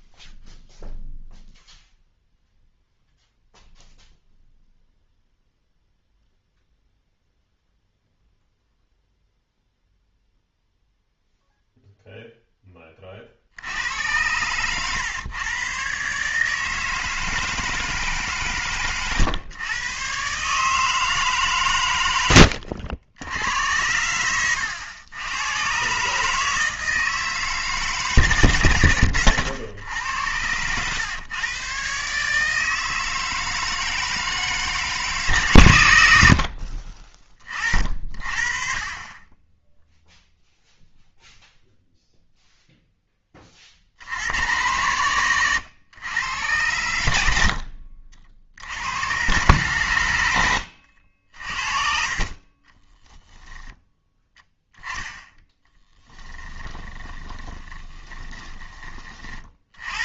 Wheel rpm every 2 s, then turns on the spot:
0, 0, 0, 0, 0, 0, 10, 110, 150, 130, 150, 90, 100, 160, 120, 110, 160, 160, 50, 40, 0, 0, 100, 100, 70, 80, 20, 10, 20, 20.
14-16 22-24 50-54 56-60